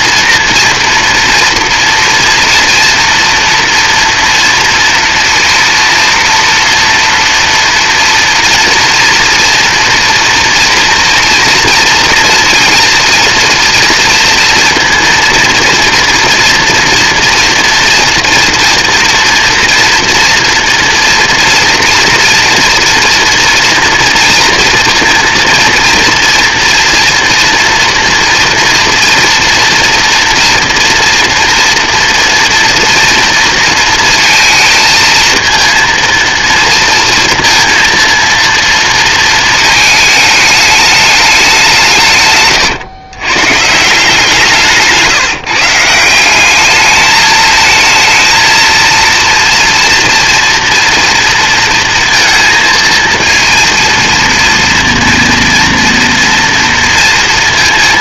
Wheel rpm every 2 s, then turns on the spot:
230, 230, 230, 230, 230, 230, 230, 230, 230, 230, 240, 230, 230, 240, 240, 240, 230, 230, 230, 230, 210, 120, 160, 210, 230, 230, 230, 230, 230.
none